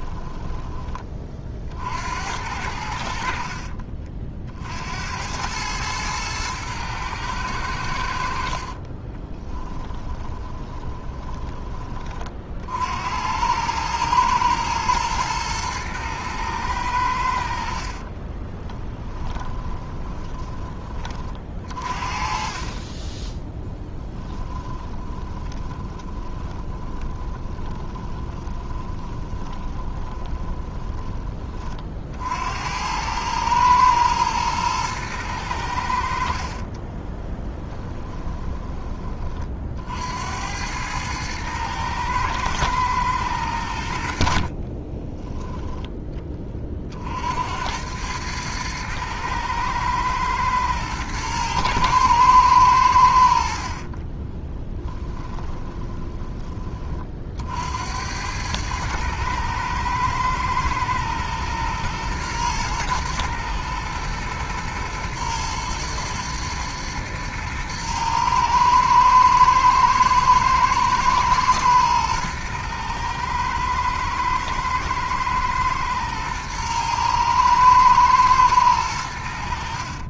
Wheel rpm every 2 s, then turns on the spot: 20, 80, 70, 110, 30, 20, 70, 110, 100, 20, 30, 30, 20, 20, 20, 20, 90, 110, 20, 20, 100, 110, 20, 50, 110, 110, 80, 10, 40, 110, 120, 110, 120, 110, 110, 110, 110, 110, 110, 90.
8-12 18-20 24-30 36-38 44-46 54-56